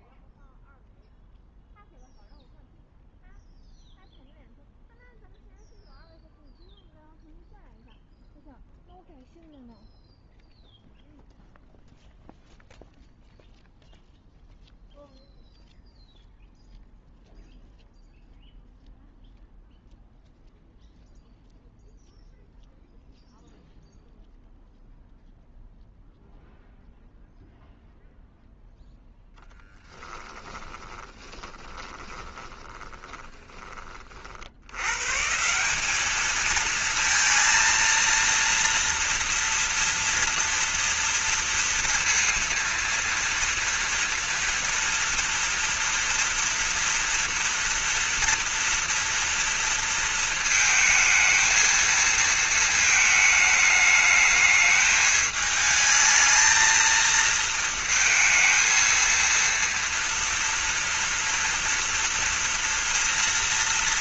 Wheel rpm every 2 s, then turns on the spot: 0, 0, 0, 0, 0, 0, 0, 0, 0, 0, 0, 0, 0, 0, 0, 20, 20, 100, 230, 230, 230, 230, 230, 230, 230, 220, 220, 210, 220, 230, 230, 230.
30-34